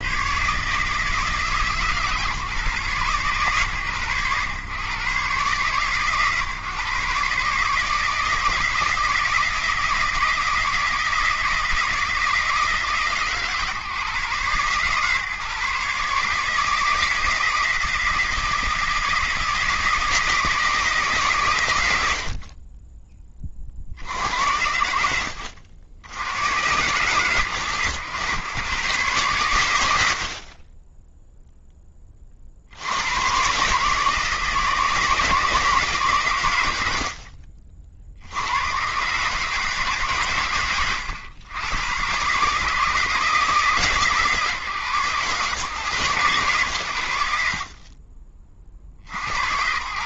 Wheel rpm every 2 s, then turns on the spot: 140, 140, 120, 140, 160, 160, 160, 140, 160, 160, 160, 40, 80, 110, 120, 40, 50, 160, 110, 100, 120, 140, 140, 120, 40.
none